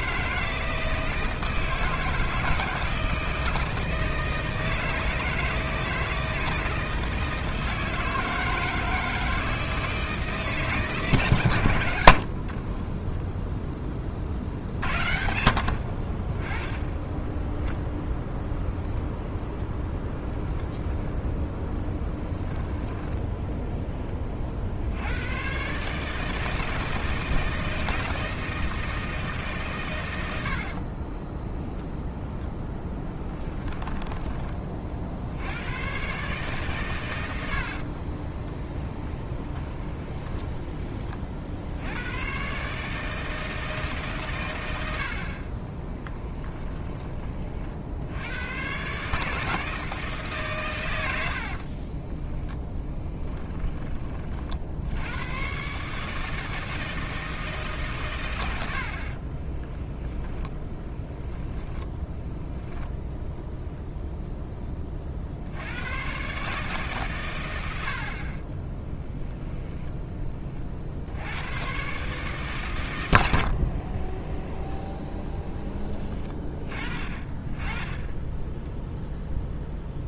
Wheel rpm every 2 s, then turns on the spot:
160, 160, 160, 160, 160, 140, 20, 60, 10, 0, 0, 10, 90, 160, 160, 40, 10, 50, 120, 10, 30, 150, 80, 30, 140, 100, 10, 80, 160, 70, 10, 10, 30, 140, 10, 60, 100, 10, 20, 0.
12-14 22-24 30-34 38-40 52-54 58-62 68-70